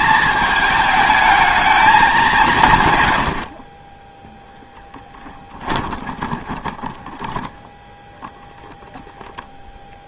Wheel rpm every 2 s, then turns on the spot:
220, 150, 0, 10, 10.
8-10